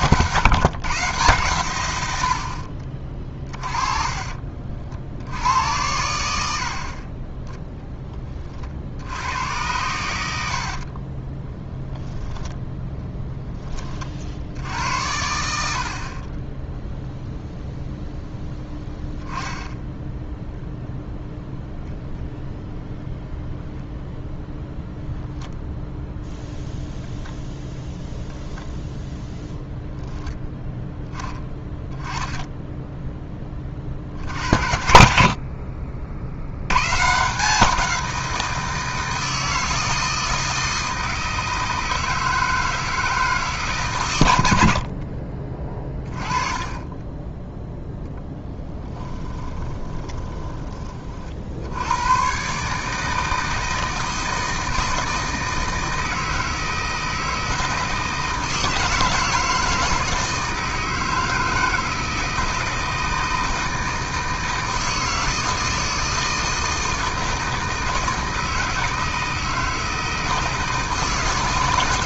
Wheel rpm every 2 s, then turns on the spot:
140, 40, 50, 50, 70, 40, 10, 80, 10, 10, 0, 0, 0, 0, 10, 10, 10, 60, 110, 160, 160, 160, 70, 20, 10, 30, 150, 160, 160, 160, 160, 160, 160, 160, 160, 160.
10-12 28-30 44-46 48-50